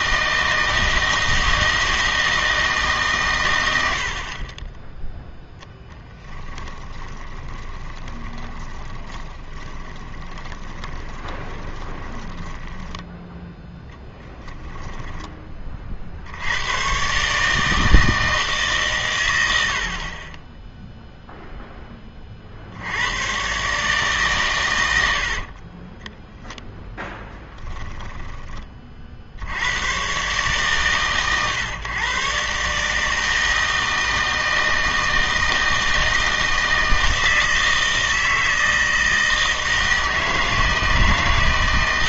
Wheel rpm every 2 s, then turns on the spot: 160, 160, 20, 20, 20, 20, 10, 10, 100, 140, 10, 70, 100, 0, 30, 130, 140, 160, 160, 160, 160.
6-16